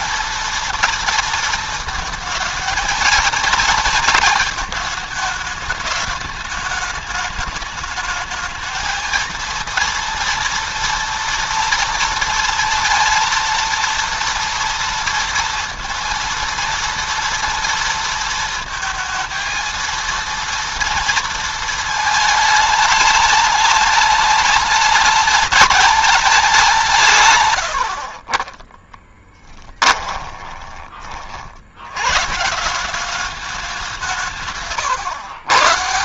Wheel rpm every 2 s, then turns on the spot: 230, 230, 220, 210, 220, 230, 230, 230, 230, 230, 230, 210, 210, 170, 20, 20, 170, 150.
28-30